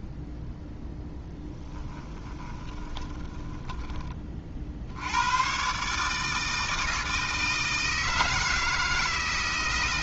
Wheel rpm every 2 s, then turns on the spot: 0, 20, 60, 160, 160.
2-4